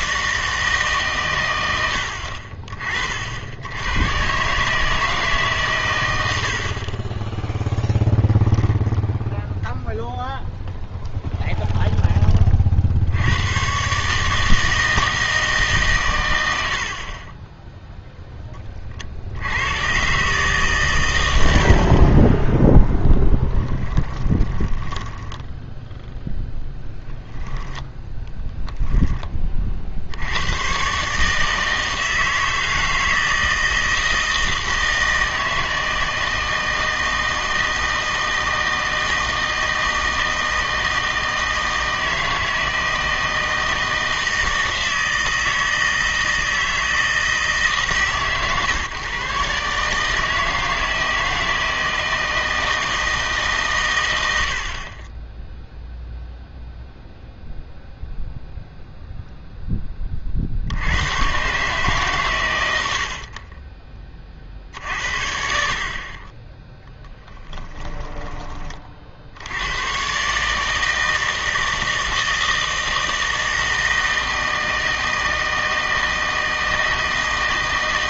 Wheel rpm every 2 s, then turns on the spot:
150, 40, 150, 30, 10, 0, 50, 160, 60, 30, 130, 0, 20, 0, 0, 120, 160, 160, 160, 160, 160, 160, 160, 160, 130, 160, 160, 40, 0, 0, 60, 100, 50, 10, 30, 160, 160, 160, 160.
16-18 24-26 62-64 66-68